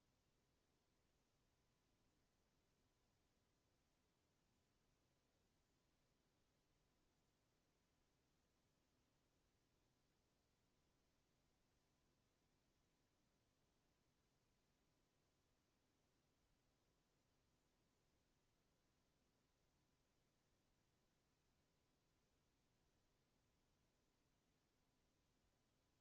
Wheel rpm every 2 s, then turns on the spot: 0, 0, 0, 0, 0, 0, 0, 0, 0, 0, 0, 0, 0.
none